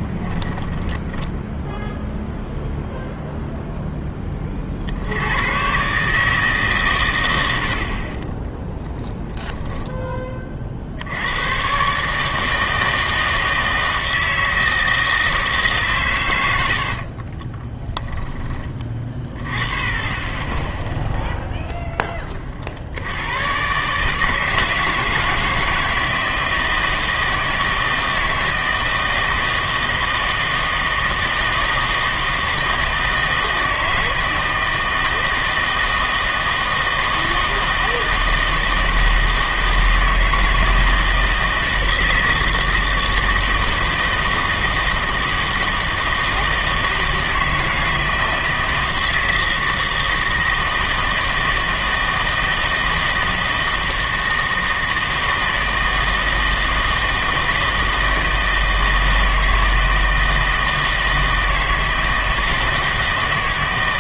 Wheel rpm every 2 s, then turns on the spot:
10, 0, 40, 150, 10, 40, 160, 160, 80, 20, 10, 50, 160, 160, 160, 160, 160, 160, 160, 160, 160, 160, 160, 160, 160, 160, 160, 160, 160, 160, 160, 160.
0-2 8-10